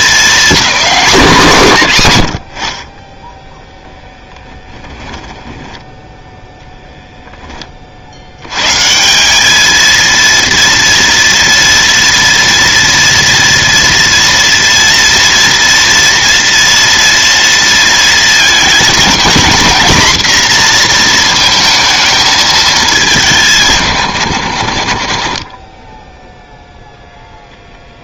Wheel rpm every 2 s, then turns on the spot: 220, 40, 10, 0, 120, 230, 240, 230, 230, 220, 240, 220, 90, 10.
4-6